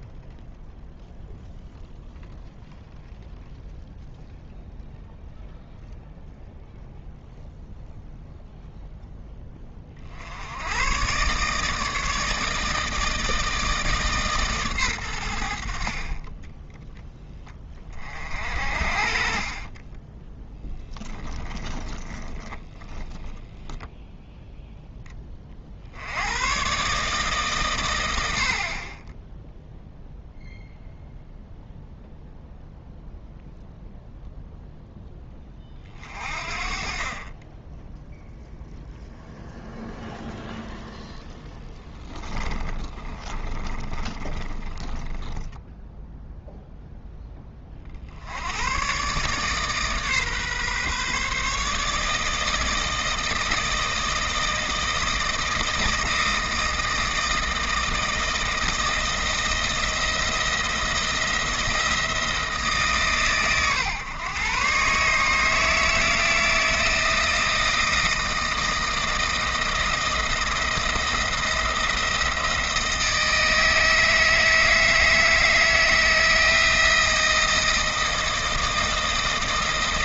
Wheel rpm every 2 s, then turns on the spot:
0, 0, 0, 0, 0, 100, 160, 130, 10, 50, 10, 20, 0, 130, 40, 0, 0, 0, 40, 0, 0, 20, 10, 0, 110, 140, 160, 160, 160, 160, 170, 150, 130, 160, 160, 170, 170, 160, 160, 170.
16-18 22-24 42-46